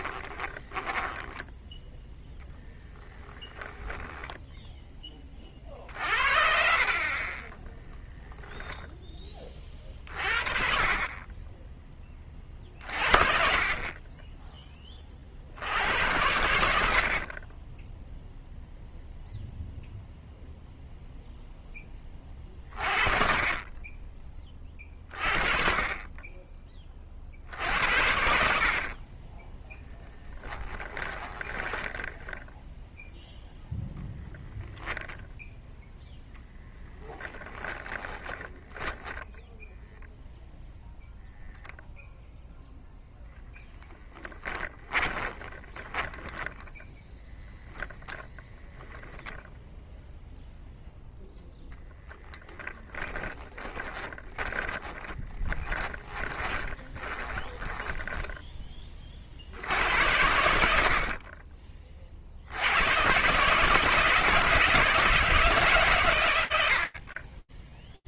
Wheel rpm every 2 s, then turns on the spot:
10, 10, 30, 40, 10, 30, 40, 20, 50, 0, 0, 30, 20, 20, 60, 10, 10, 10, 10, 10, 0, 10, 10, 10, 10, 0, 10, 10, 10, 10, 80, 60, 150, 110.
0-2 8-10 30-32 38-40 44-48 52-60